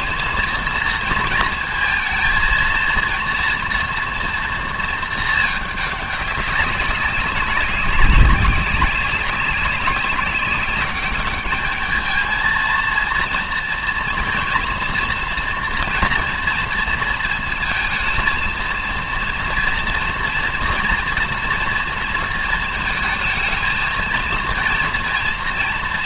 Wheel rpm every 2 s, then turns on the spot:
230, 230, 230, 200, 200, 200, 220, 240, 230, 230, 230, 230, 230.
none